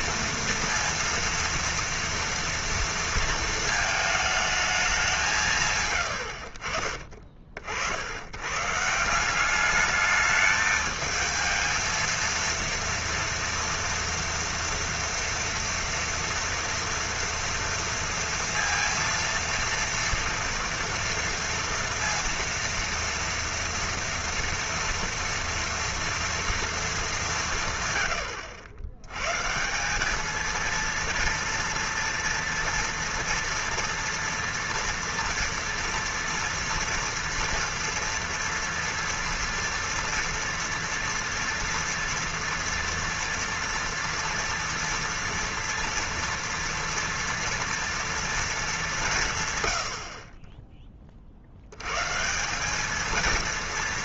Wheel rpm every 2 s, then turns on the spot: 230, 230, 220, 60, 130, 210, 230, 230, 240, 230, 230, 230, 230, 230, 100, 230, 230, 230, 230, 230, 230, 230, 230, 230, 220, 20, 180.
6-8